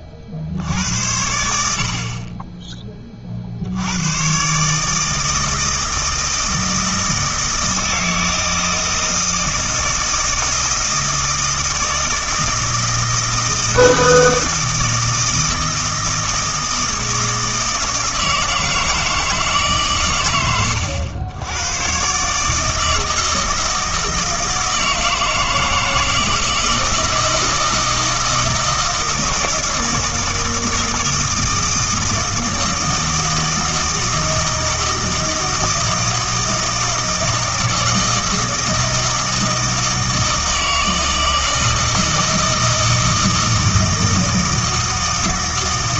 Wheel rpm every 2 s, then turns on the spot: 50, 20, 150, 160, 160, 160, 160, 160, 160, 160, 100, 160, 160, 160, 160, 160, 160, 160, 160, 160, 160, 160, 160.
none